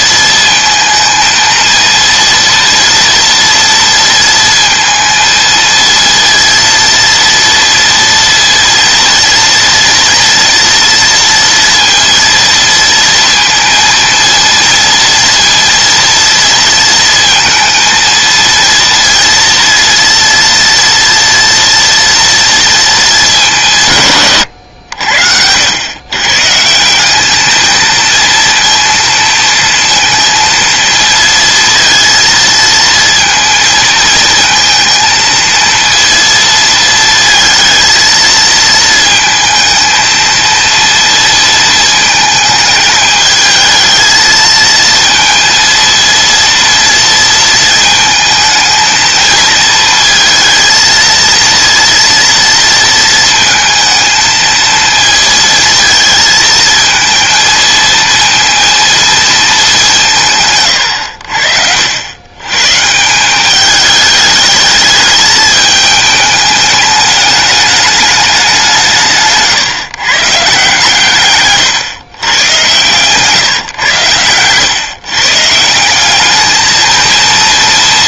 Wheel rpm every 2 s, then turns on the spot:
230, 240, 230, 230, 230, 230, 230, 230, 230, 230, 230, 230, 100, 170, 230, 230, 230, 230, 230, 220, 230, 220, 230, 230, 220, 230, 230, 230, 220, 230, 110, 140, 210, 210, 180, 140, 140, 130, 220.
none